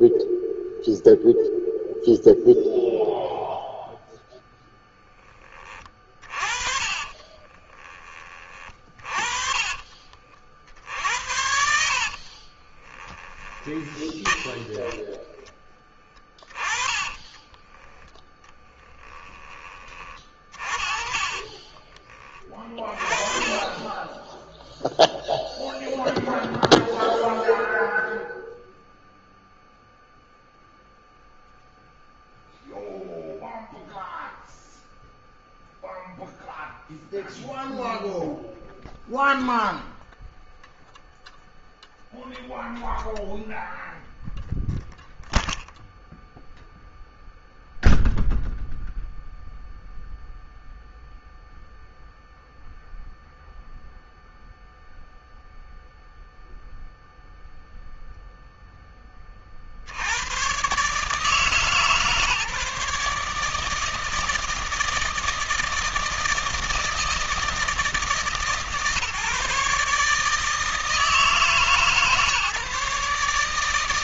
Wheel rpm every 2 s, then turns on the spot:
0, 0, 10, 30, 30, 60, 20, 10, 20, 20, 40, 30, 0, 0, 0, 0, 0, 0, 0, 0, 0, 0, 0, 0, 0, 0, 0, 0, 0, 20, 140, 150, 160, 160, 150, 160, 140.
6-8 12-14 16-18 20-24